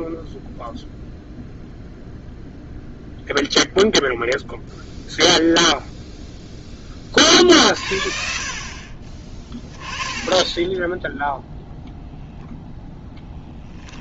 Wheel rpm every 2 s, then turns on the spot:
0, 0, 0, 0, 40, 10, 0.
10-12